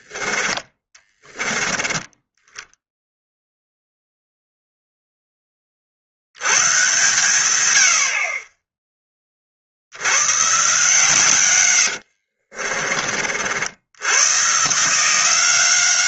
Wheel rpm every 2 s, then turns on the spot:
30, 10, 0, 100, 20, 130, 50, 140.
0-2 12-14